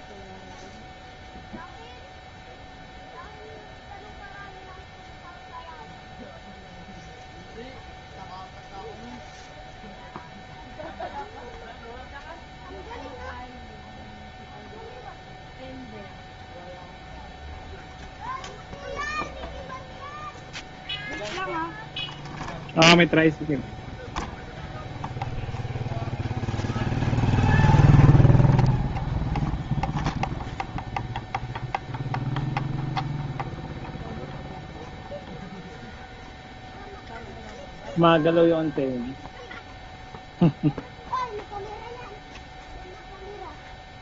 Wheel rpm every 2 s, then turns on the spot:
0, 0, 0, 0, 0, 0, 0, 0, 0, 0, 0, 0, 0, 0, 0, 0, 0, 0, 0, 0, 0, 0.
none